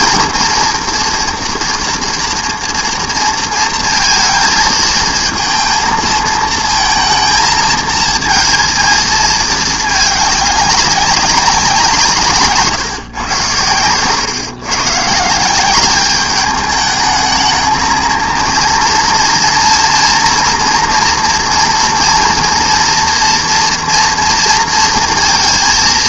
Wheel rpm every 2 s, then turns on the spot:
230, 230, 220, 220, 220, 200, 140, 120, 210, 230, 240, 230, 230.
none